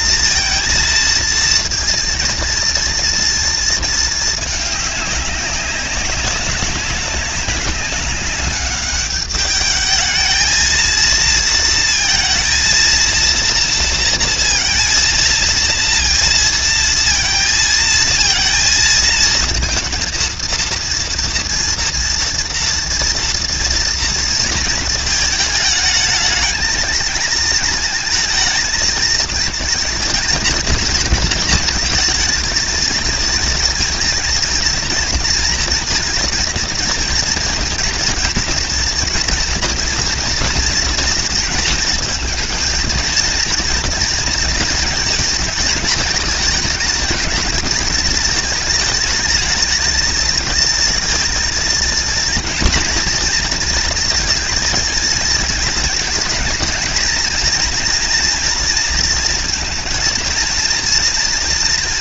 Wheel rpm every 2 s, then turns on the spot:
230, 230, 210, 190, 200, 230, 230, 230, 230, 220, 230, 240, 230, 220, 220, 230, 230, 240, 230, 230, 230, 230, 230, 220, 220, 230, 230, 230, 220, 230, 230.
none